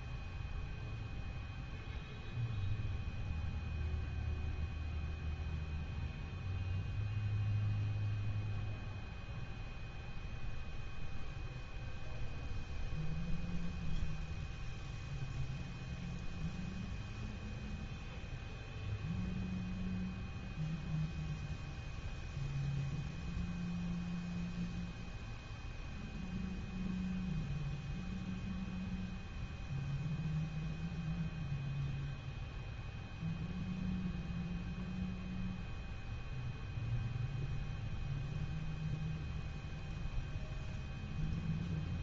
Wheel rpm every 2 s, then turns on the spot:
0, 0, 0, 0, 0, 0, 0, 0, 0, 0, 0, 0, 0, 0, 0, 0, 0, 0, 0, 0, 0.
none